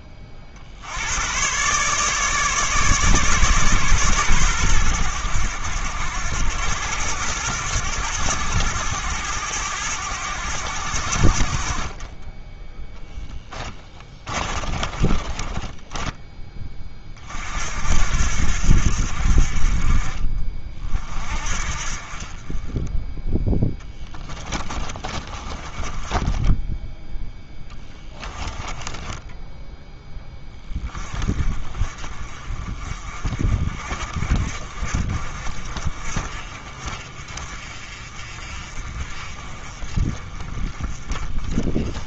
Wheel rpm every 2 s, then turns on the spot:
60, 150, 110, 100, 100, 90, 10, 30, 20, 70, 40, 20, 30, 10, 20, 20, 40, 50, 50, 50, 30.
14-16 24-30